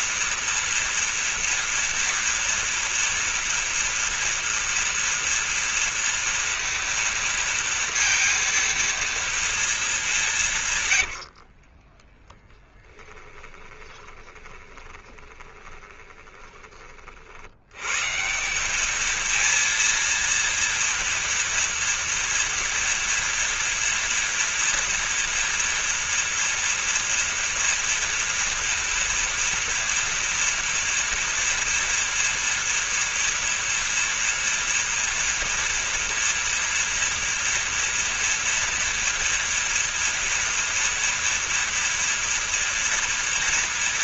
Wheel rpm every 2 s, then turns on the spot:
230, 230, 230, 230, 230, 130, 10, 20, 30, 210, 230, 230, 230, 230, 230, 230, 230, 230, 230, 230, 230, 240.
10-16